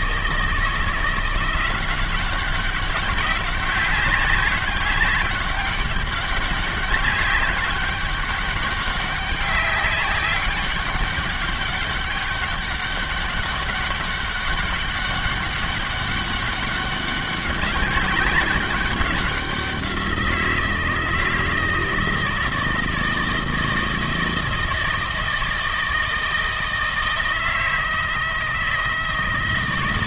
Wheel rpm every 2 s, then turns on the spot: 160, 190, 200, 200, 200, 200, 200, 200, 200, 200, 160, 160, 160, 160, 160.
none